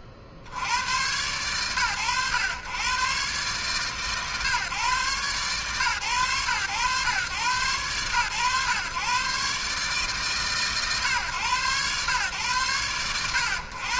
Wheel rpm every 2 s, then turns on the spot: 70, 110, 140, 120, 120, 140, 110.
none